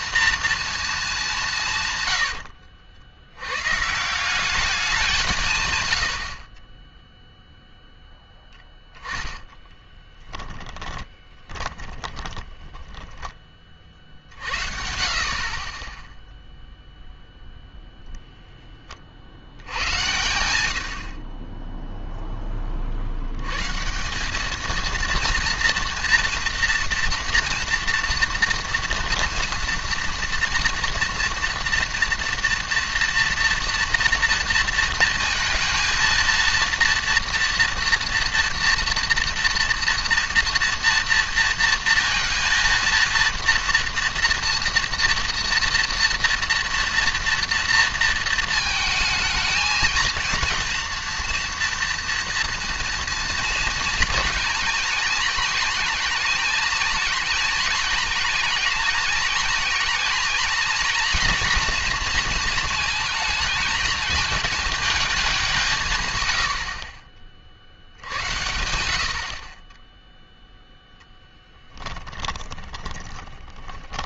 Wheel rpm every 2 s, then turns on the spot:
230, 70, 200, 30, 10, 10, 10, 50, 0, 10, 90, 30, 220, 230, 230, 230, 240, 230, 230, 230, 230, 230, 230, 230, 220, 230, 230, 230, 220, 220, 230, 230, 220, 70, 80, 0, 10.
2-4 8-14 72-74